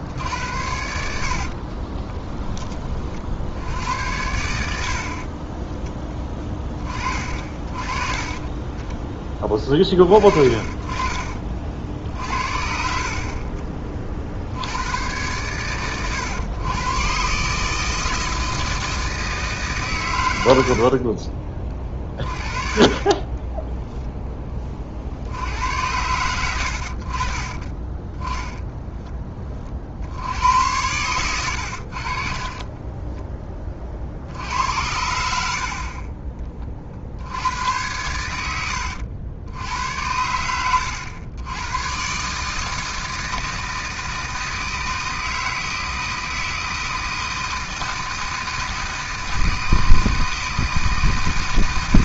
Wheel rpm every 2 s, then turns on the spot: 70, 20, 70, 20, 20, 30, 50, 80, 120, 160, 70, 30, 30, 90, 10, 100, 30, 80, 30, 90, 90, 160, 160, 160, 160, 160.
10-12 20-24 32-34